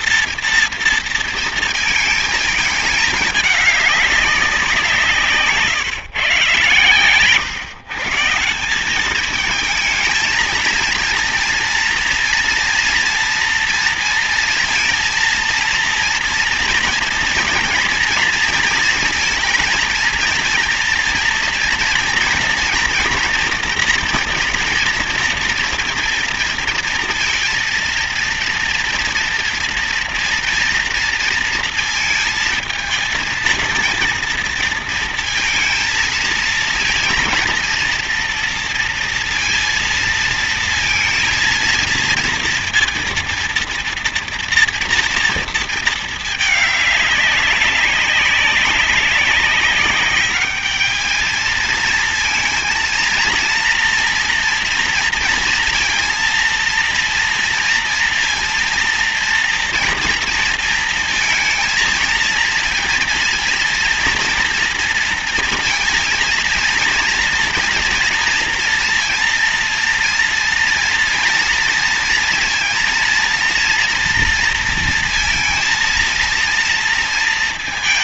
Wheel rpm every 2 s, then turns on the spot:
230, 220, 190, 130, 180, 220, 230, 230, 230, 230, 230, 230, 240, 230, 230, 230, 230, 230, 230, 240, 230, 230, 230, 210, 200, 210, 230, 240, 230, 230, 230, 230, 230, 230, 230, 230, 230, 230, 230.
none